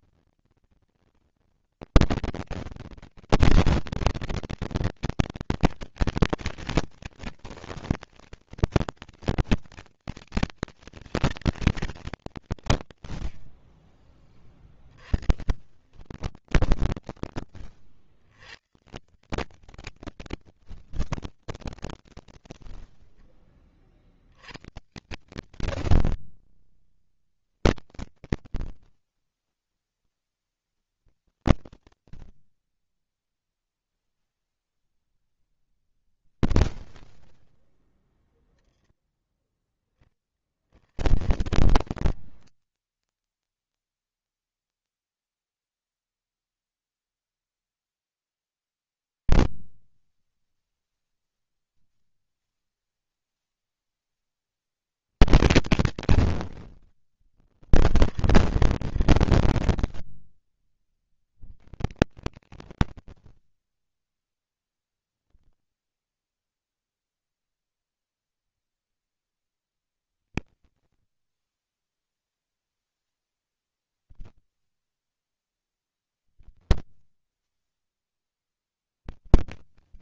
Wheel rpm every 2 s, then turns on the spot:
230, 230, 230, 230, 230, 230, 80, 20, 30, 140, 50, 10, 100, 50, 20, 20, 10, 0, 0, 0, 30, 0, 0, 0, 0, 0, 0, 90, 90, 40, 50, 90, 10, 0, 20, 40, 10, 20, 30, 90.
14-18 20-22 30-34 40-42 56-60 64-66